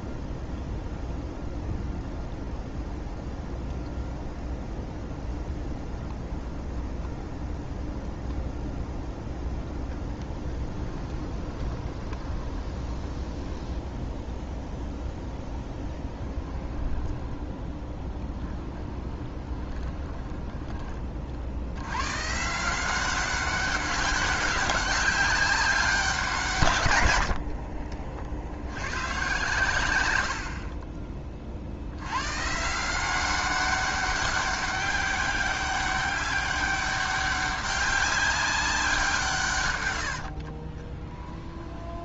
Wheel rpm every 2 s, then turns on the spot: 0, 0, 0, 0, 0, 10, 20, 0, 10, 20, 20, 160, 190, 100, 110, 30, 160, 200, 200, 180, 20.
10-14 16-22 40-42